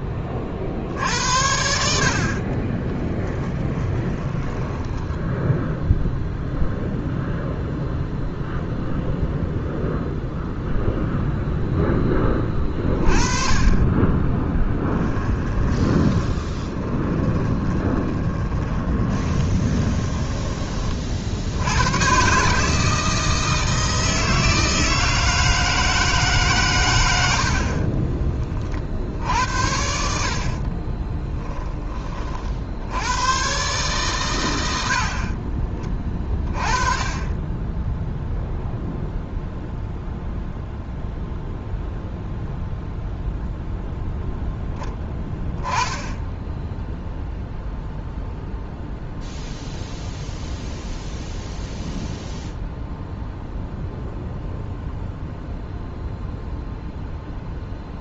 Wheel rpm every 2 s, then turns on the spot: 60, 30, 20, 0, 0, 0, 20, 10, 10, 10, 20, 160, 160, 120, 50, 40, 80, 80, 20, 0, 0, 0, 0, 0, 0, 0, 0, 0, 0.
2-6 14-20 30-32